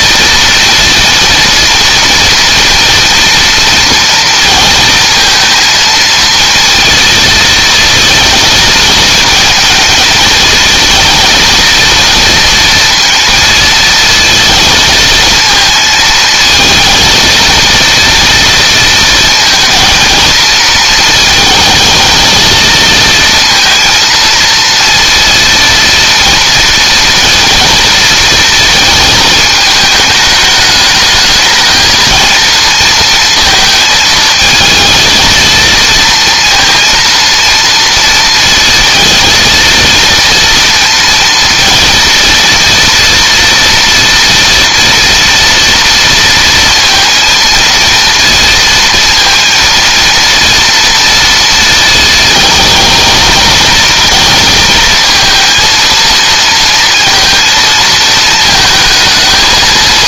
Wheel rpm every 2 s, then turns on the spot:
230, 230, 230, 230, 220, 230, 230, 230, 230, 230, 230, 230, 230, 230, 220, 220, 230, 230, 230, 230, 230, 230, 240, 230, 230, 230, 220, 230, 230, 220.
none